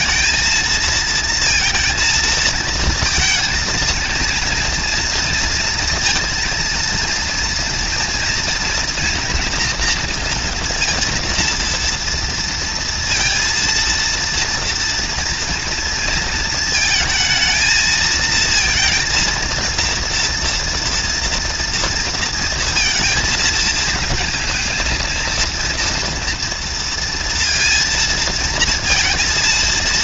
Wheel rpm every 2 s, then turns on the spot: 220, 220, 230, 230, 230, 230, 230, 230, 220, 230, 230, 230, 230, 230, 230.
none